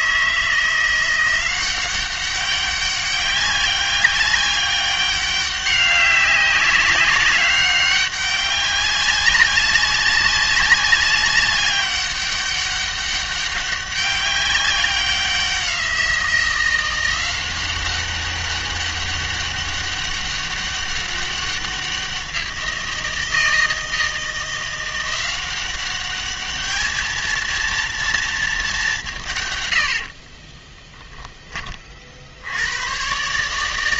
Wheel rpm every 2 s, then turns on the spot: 170, 200, 200, 200, 200, 200, 200, 190, 180, 200, 200, 170, 170, 210, 210, 20, 100.
30-32